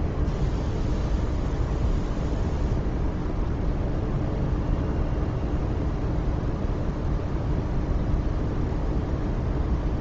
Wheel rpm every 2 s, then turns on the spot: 0, 0, 0, 0, 0.
none